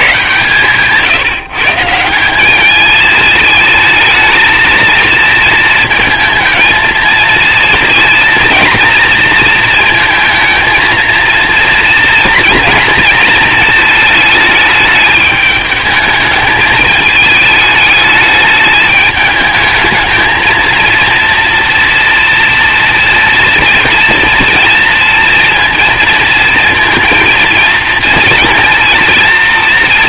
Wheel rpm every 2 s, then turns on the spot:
140, 210, 220, 230, 230, 230, 230, 220, 220, 210, 220, 240, 230, 230, 230.
none